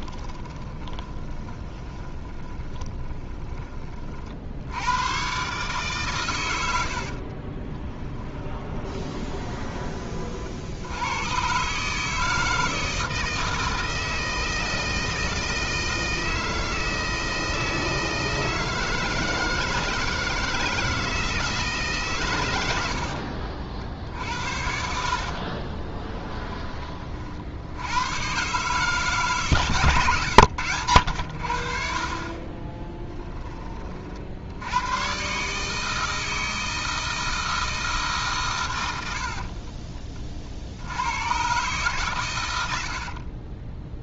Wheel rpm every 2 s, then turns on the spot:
20, 20, 90, 80, 20, 70, 160, 160, 160, 160, 160, 90, 60, 20, 140, 100, 20, 90, 160, 120, 80, 80.
0-4 6-10 22-26 32-34